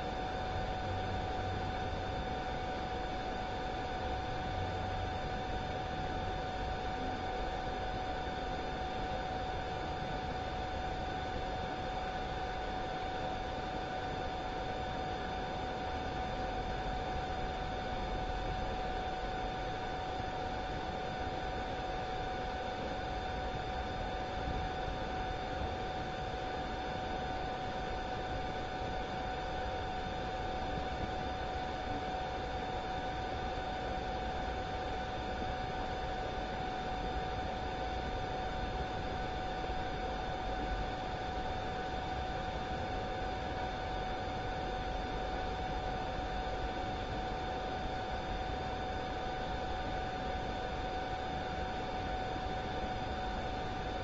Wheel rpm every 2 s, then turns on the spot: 0, 0, 0, 0, 0, 0, 0, 0, 0, 0, 0, 0, 0, 0, 0, 0, 0, 0, 0, 0, 0, 0, 0, 0, 0, 0, 0.
none